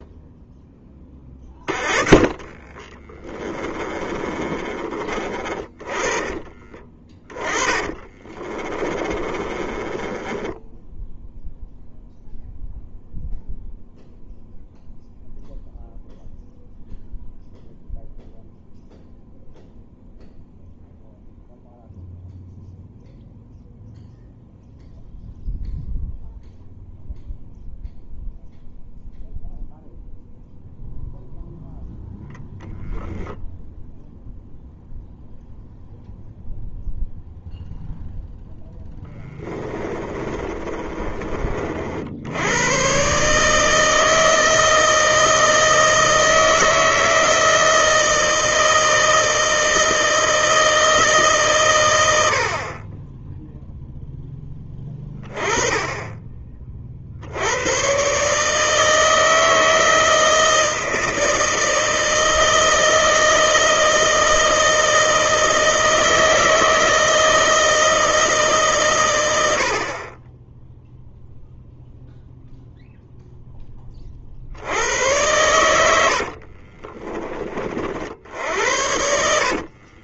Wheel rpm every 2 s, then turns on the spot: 10, 20, 30, 20, 30, 10, 0, 0, 0, 0, 0, 0, 0, 0, 0, 0, 0, 0, 0, 0, 30, 110, 160, 160, 160, 160, 40, 10, 40, 150, 160, 160, 160, 160, 140, 10, 0, 80, 40, 80.
4-12 40-42 76-80